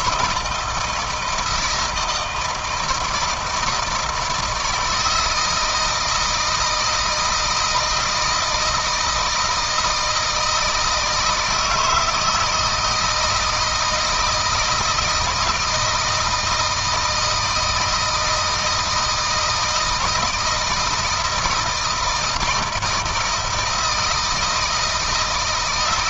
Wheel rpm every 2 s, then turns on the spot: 160, 160, 160, 160, 160, 160, 160, 160, 160, 160, 160, 160, 160.
none